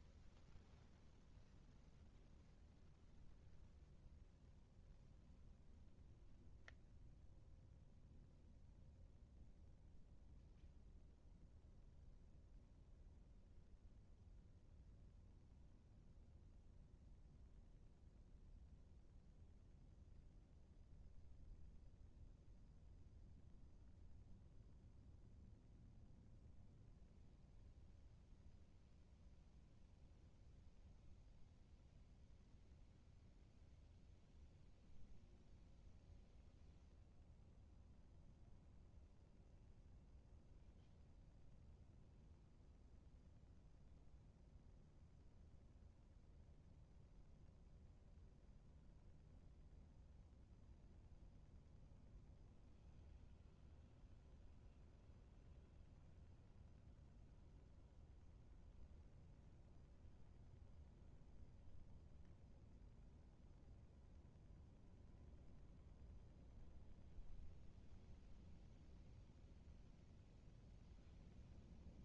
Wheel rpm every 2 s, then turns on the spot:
0, 0, 0, 0, 0, 0, 0, 0, 0, 0, 0, 0, 0, 0, 0, 0, 0, 0, 0, 0, 0, 0, 0, 0, 0, 0, 0, 0, 0, 0, 0, 0, 0, 0, 0, 0.
none